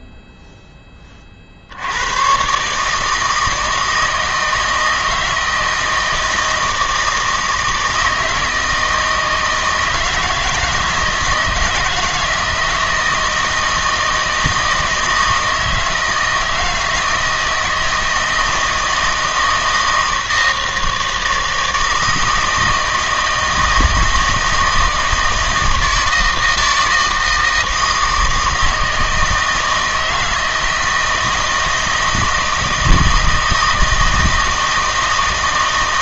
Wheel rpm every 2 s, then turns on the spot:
10, 150, 160, 160, 160, 160, 160, 160, 160, 160, 160, 160, 160, 160, 160, 160, 170, 160.
none